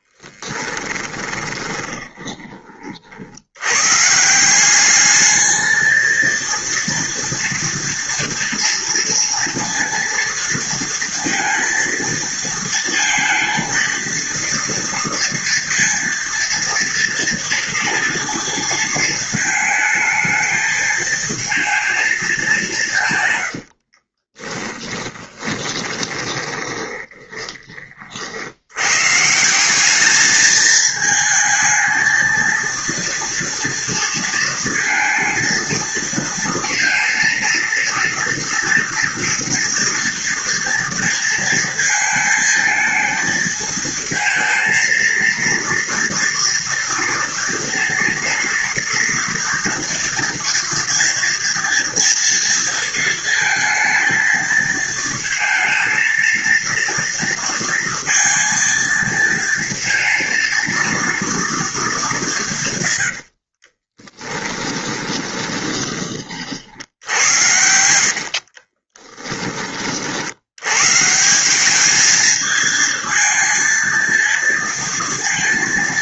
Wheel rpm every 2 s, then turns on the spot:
20, 50, 200, 230, 230, 230, 230, 230, 230, 230, 220, 150, 20, 20, 120, 220, 230, 230, 230, 230, 230, 220, 230, 230, 230, 230, 230, 230, 230, 230, 230, 100, 20, 70, 30, 140, 220, 230.
0-2 24-28 62-70